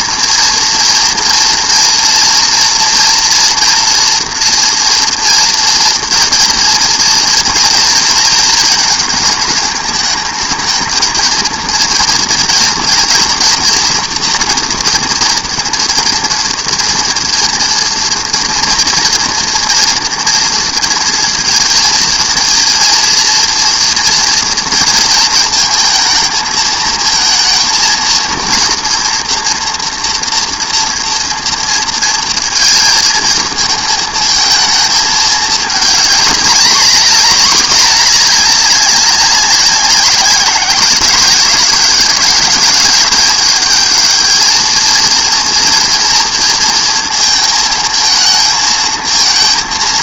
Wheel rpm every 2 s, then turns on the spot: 230, 230, 230, 230, 230, 220, 240, 230, 230, 230, 230, 230, 230, 220, 230, 230, 230, 220, 220, 200, 180, 210, 220, 230, 220.
none